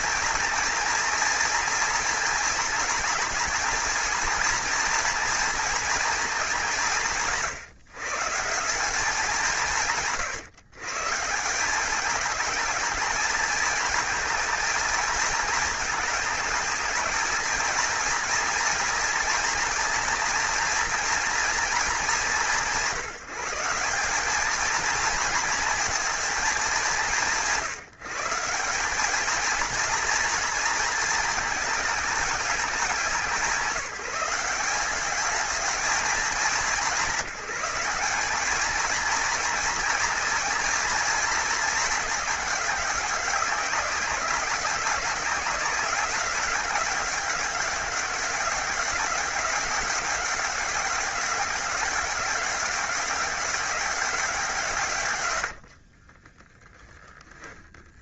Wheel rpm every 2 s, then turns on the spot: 230, 230, 240, 160, 190, 150, 220, 220, 210, 230, 240, 180, 220, 190, 200, 220, 200, 200, 190, 220, 220, 190, 200, 200, 200, 200, 200, 150, 10.
none